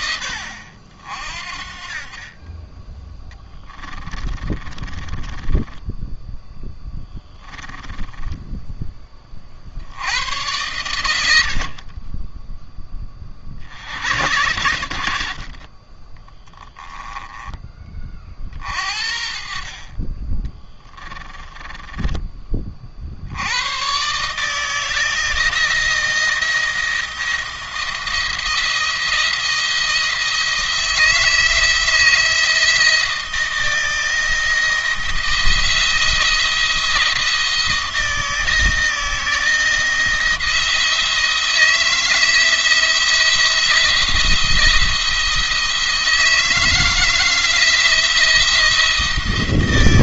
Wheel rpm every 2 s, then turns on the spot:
70, 20, 20, 10, 20, 110, 10, 100, 10, 50, 20, 40, 160, 170, 170, 160, 160, 160, 170, 160, 170, 160, 170, 160, 170.
4-8 16-18 20-22